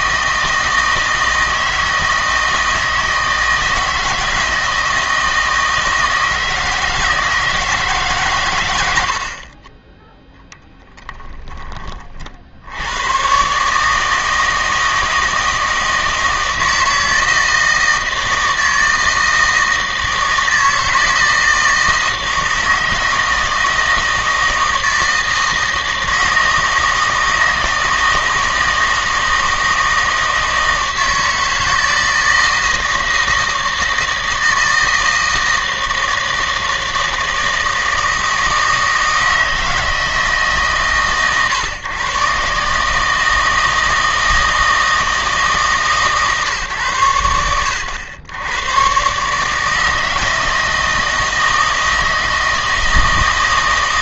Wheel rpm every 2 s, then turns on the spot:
160, 160, 160, 160, 100, 0, 80, 160, 160, 160, 160, 160, 160, 160, 160, 160, 160, 160, 160, 160, 140, 140, 160, 130, 110, 160, 160.
none